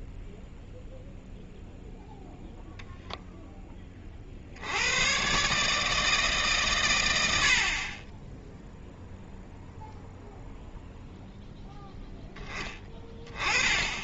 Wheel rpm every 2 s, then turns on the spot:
0, 0, 90, 120, 0, 0, 20.
none